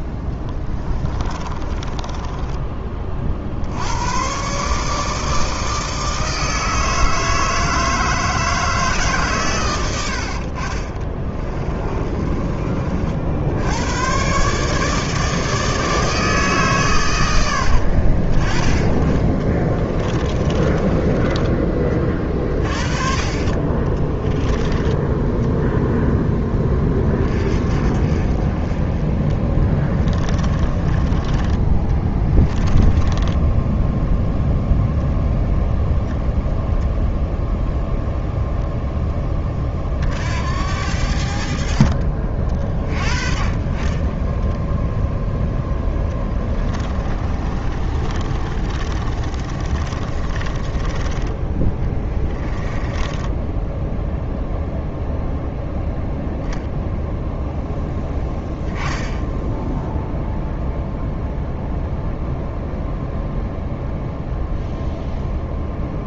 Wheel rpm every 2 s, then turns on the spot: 20, 20, 140, 160, 150, 40, 40, 150, 140, 30, 20, 30, 10, 20, 30, 20, 10, 0, 0, 10, 70, 40, 0, 30, 30, 20, 20, 0, 0, 10, 0, 0, 0.
0-2 10-12 18-22 30-34 46-54